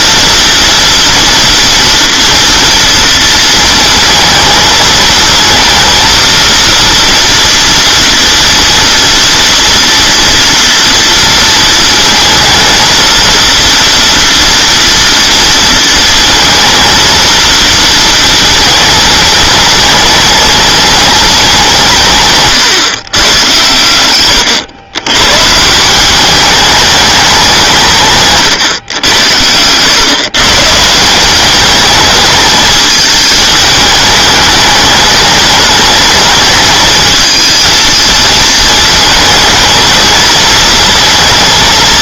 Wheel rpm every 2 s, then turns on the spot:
230, 230, 220, 230, 230, 230, 230, 230, 230, 220, 220, 140, 120, 210, 120, 150, 210, 210, 220, 220, 220.
none